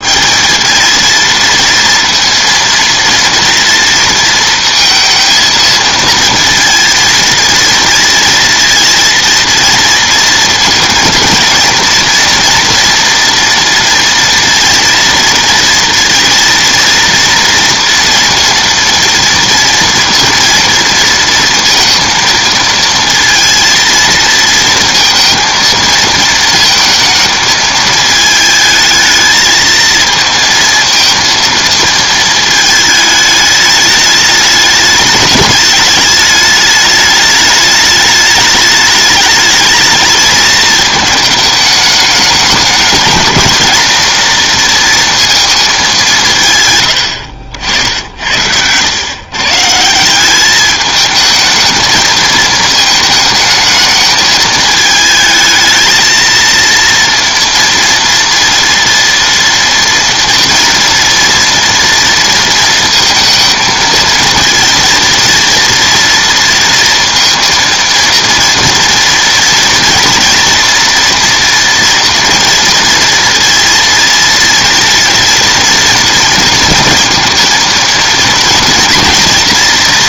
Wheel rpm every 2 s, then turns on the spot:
220, 230, 230, 230, 230, 230, 230, 230, 230, 230, 230, 220, 230, 220, 220, 230, 220, 210, 210, 210, 220, 210, 230, 120, 100, 210, 220, 220, 230, 230, 230, 230, 230, 230, 240, 230, 230, 230, 230, 230.
none